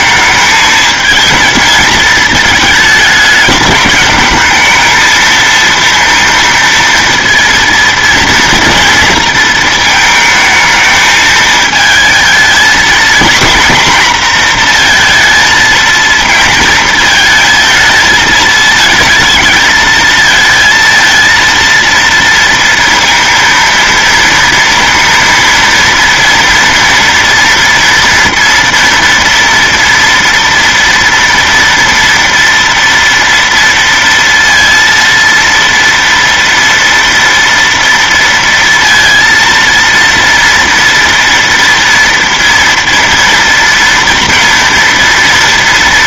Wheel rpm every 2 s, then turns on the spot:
210, 220, 220, 230, 230, 220, 230, 230, 230, 220, 230, 230, 230, 230, 230, 230, 230, 230, 230, 230, 230, 230, 230.
none